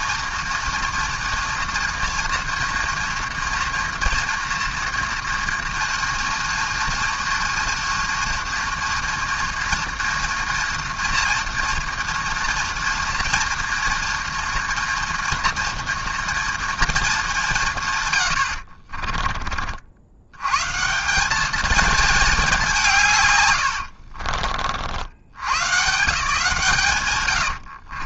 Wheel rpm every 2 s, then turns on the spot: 230, 230, 230, 230, 240, 230, 240, 230, 220, 40, 160, 160, 70, 130.
18-20